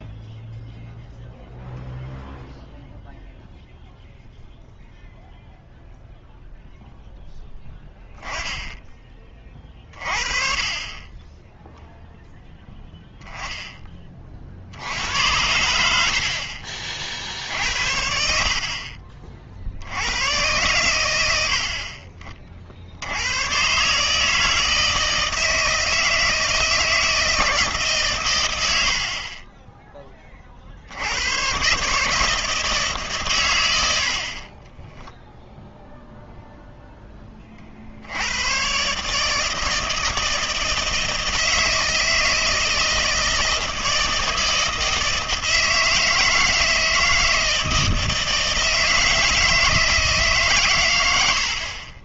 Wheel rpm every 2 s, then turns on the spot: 0, 0, 0, 0, 10, 30, 10, 60, 40, 50, 120, 60, 160, 160, 80, 60, 150, 20, 0, 120, 160, 160, 160, 160, 160, 140.
none